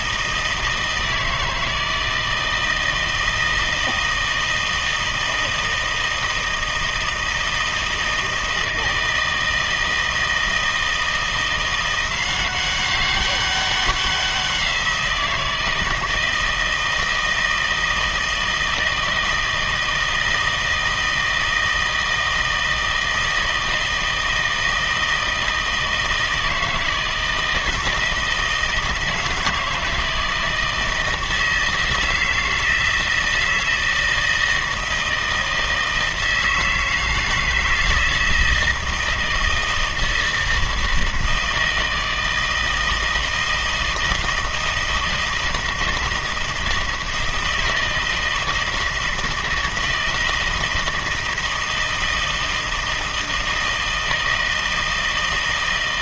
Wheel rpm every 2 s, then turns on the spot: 160, 160, 160, 160, 160, 160, 190, 180, 160, 160, 160, 160, 160, 160, 160, 160, 160, 160, 160, 160, 160, 160, 160, 160, 160, 160, 160, 160.
none